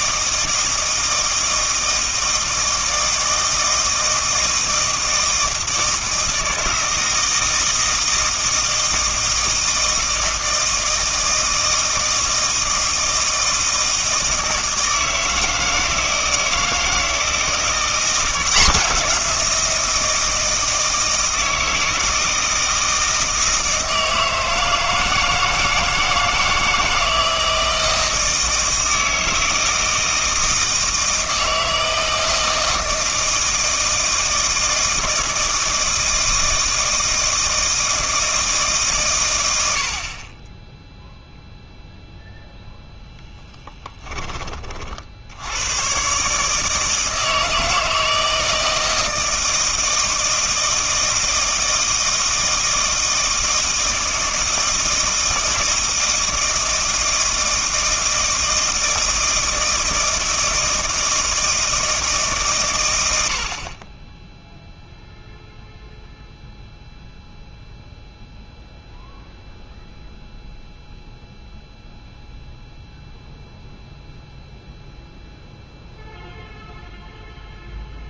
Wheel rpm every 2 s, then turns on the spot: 160, 160, 160, 160, 160, 160, 160, 160, 160, 180, 160, 160, 160, 160, 160, 160, 160, 160, 160, 140, 10, 0, 40, 160, 160, 160, 160, 160, 160, 160, 160, 110, 0, 0, 0, 0, 0, 0, 0.
none